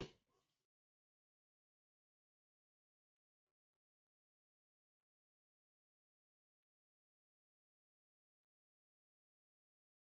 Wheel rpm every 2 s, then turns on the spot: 0, 0, 0, 0, 0.
none